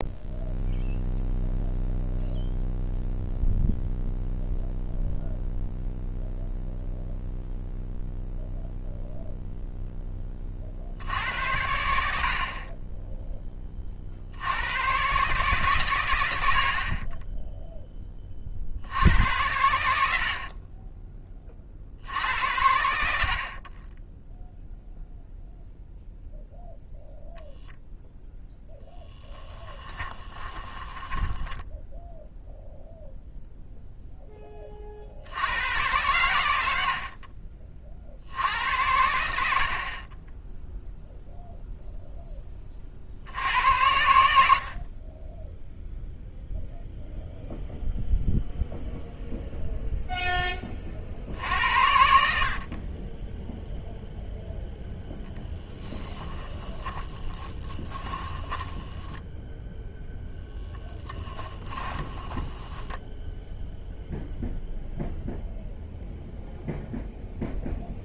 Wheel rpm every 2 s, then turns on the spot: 0, 0, 0, 0, 0, 60, 20, 120, 50, 70, 30, 80, 0, 0, 10, 20, 0, 40, 70, 80, 0, 40, 50, 0, 0, 40, 40, 0, 20, 10, 10, 10, 0, 0.
28-32 56-60 62-64